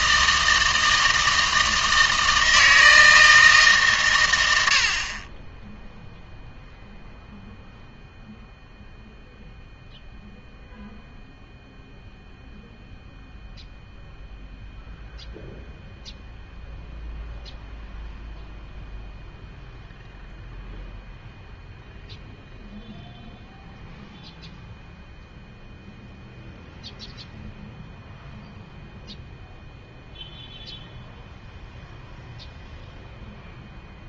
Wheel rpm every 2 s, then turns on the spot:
160, 160, 70, 0, 0, 0, 0, 0, 0, 0, 0, 0, 0, 0, 0, 0, 0.
none